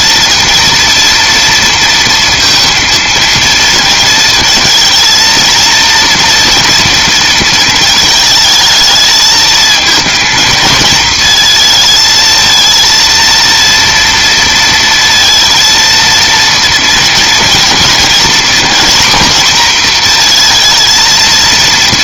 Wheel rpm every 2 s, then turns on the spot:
230, 230, 230, 230, 220, 220, 230, 230, 230, 240, 230.
none